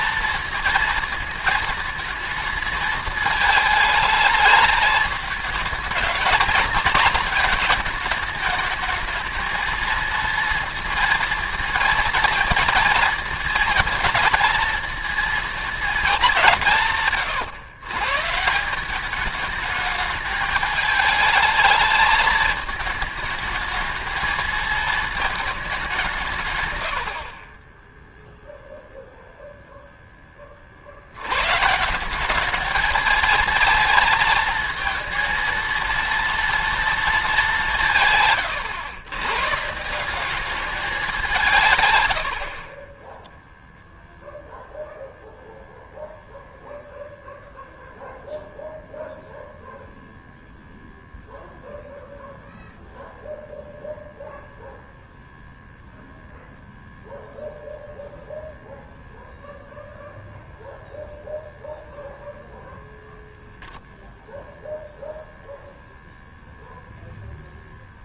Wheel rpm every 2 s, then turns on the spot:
230, 220, 210, 220, 210, 230, 230, 230, 160, 170, 220, 220, 220, 130, 0, 40, 210, 220, 230, 110, 200, 40, 0, 0, 0, 0, 0, 0, 0, 0, 0, 0, 0, 0.
42-44